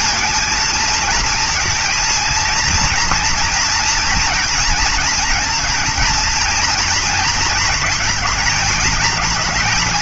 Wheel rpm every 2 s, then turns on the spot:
230, 230, 230, 230, 220.
none